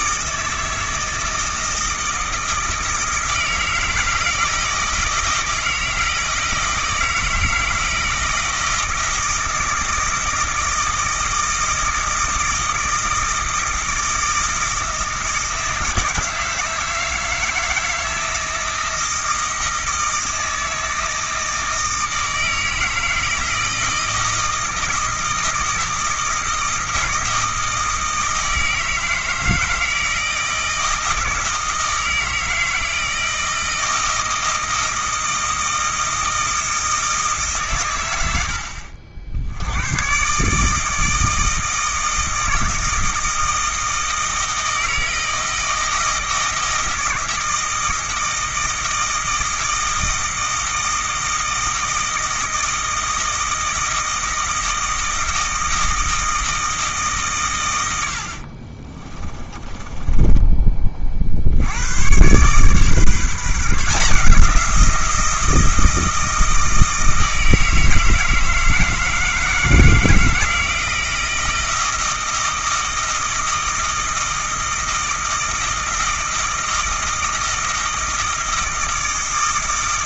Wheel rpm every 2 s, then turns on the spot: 160, 160, 160, 160, 160, 160, 160, 160, 160, 160, 160, 160, 160, 160, 160, 160, 160, 160, 160, 80, 150, 160, 160, 160, 160, 160, 160, 160, 160, 50, 30, 130, 170, 160, 160, 160, 160, 160, 160, 160.
58-60